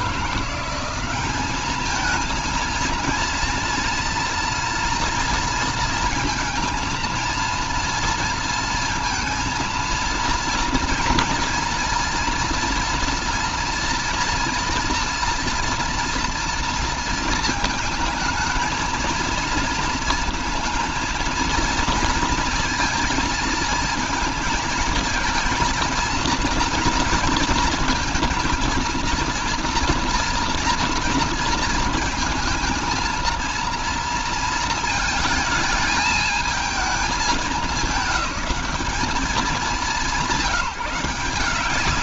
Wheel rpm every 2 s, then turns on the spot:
190, 230, 230, 230, 230, 230, 230, 230, 230, 220, 230, 230, 220, 230, 230, 230, 230, 230, 220, 190, 170.
none